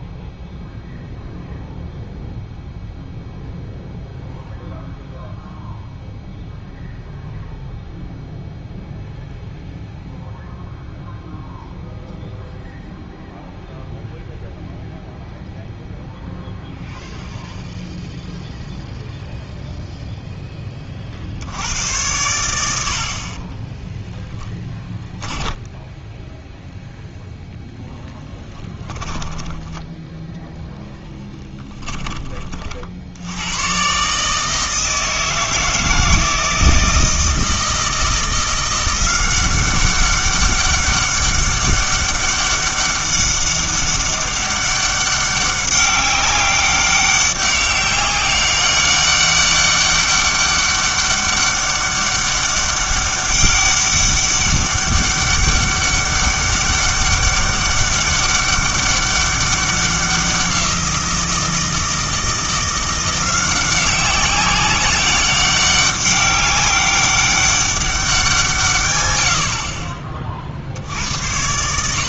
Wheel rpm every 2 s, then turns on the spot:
0, 0, 0, 0, 0, 0, 0, 0, 0, 0, 20, 80, 10, 0, 10, 0, 50, 160, 160, 180, 200, 200, 200, 200, 200, 200, 200, 200, 200, 200, 180, 170, 190, 200, 140, 60.
28-30